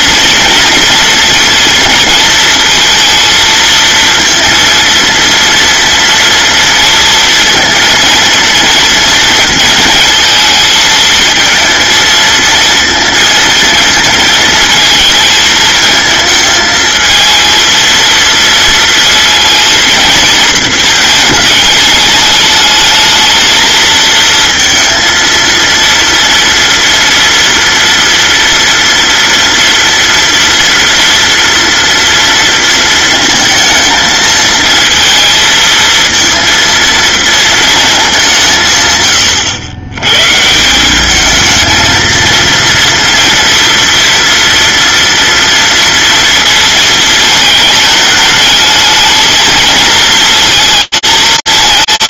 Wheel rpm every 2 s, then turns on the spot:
240, 230, 230, 230, 230, 220, 230, 220, 220, 230, 220, 210, 230, 230, 230, 230, 230, 230, 230, 150, 160, 230, 230, 220, 220, 220.
none